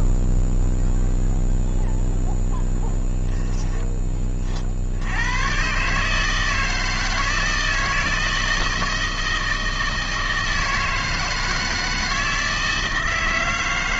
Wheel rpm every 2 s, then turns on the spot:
0, 0, 40, 160, 160, 160, 160.
none